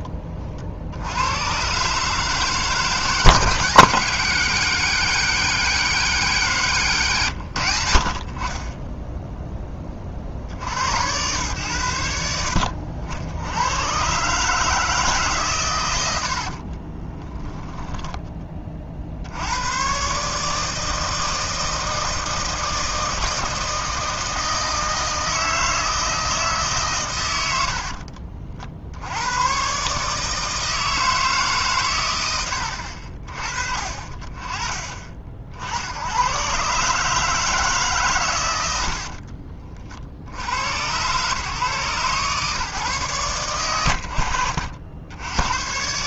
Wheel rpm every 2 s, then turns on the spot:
70, 140, 160, 140, 20, 90, 70, 150, 30, 50, 160, 160, 160, 140, 70, 160, 70, 30, 140, 80, 100, 140, 80.
16-18 38-40